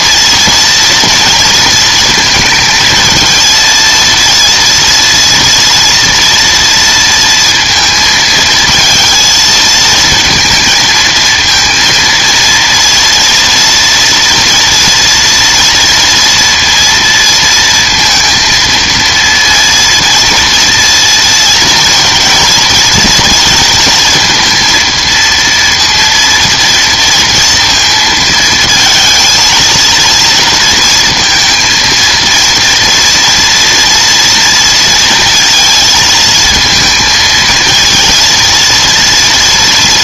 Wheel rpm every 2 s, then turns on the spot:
230, 230, 230, 230, 230, 230, 240, 230, 230, 230, 230, 220, 230, 230, 220, 230, 230, 230, 220, 230.
none